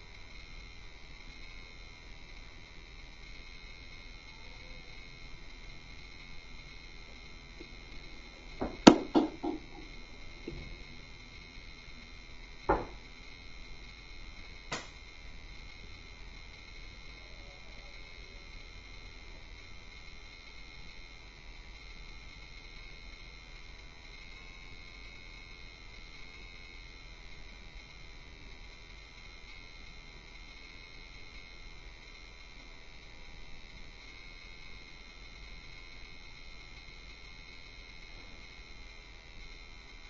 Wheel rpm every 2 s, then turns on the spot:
0, 0, 0, 0, 0, 0, 0, 0, 0, 0, 0, 0, 0, 0, 0, 0, 0, 0, 0, 0.
none